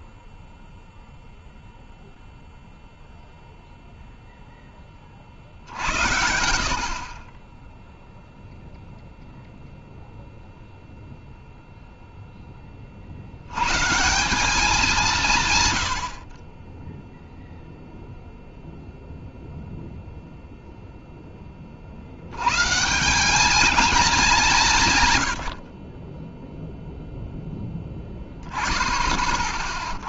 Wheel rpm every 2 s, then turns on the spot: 0, 0, 60, 0, 0, 0, 150, 70, 0, 0, 50, 210, 30, 10, 40.
none